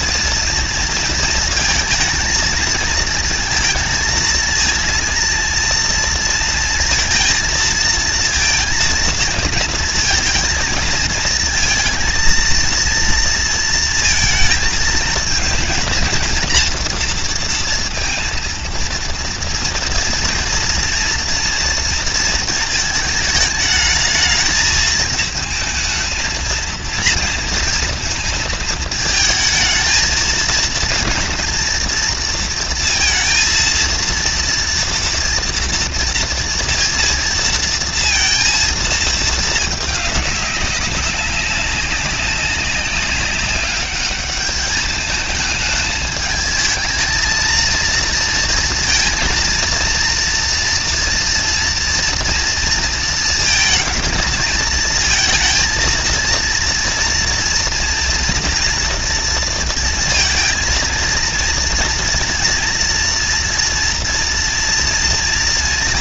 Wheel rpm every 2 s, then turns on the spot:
220, 230, 230, 230, 230, 230, 230, 230, 230, 230, 230, 220, 220, 230, 220, 230, 230, 230, 230, 220, 190, 200, 210, 220, 230, 240, 230, 230, 230, 230, 230, 230, 230.
none